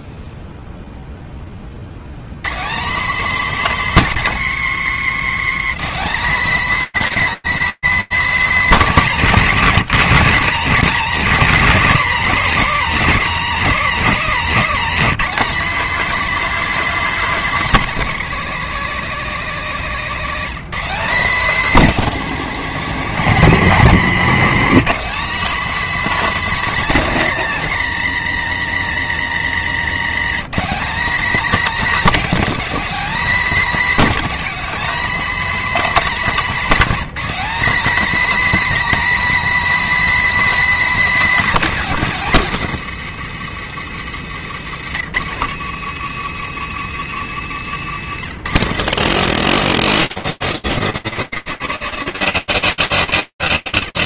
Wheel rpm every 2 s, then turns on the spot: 20, 250, 170, 290, 190, 190, 200, 240, 250, 220, 220, 210, 260, 220, 130, 240, 250, 270, 240, 290, 260, 170, 140, 150, 180, 210, 220.
none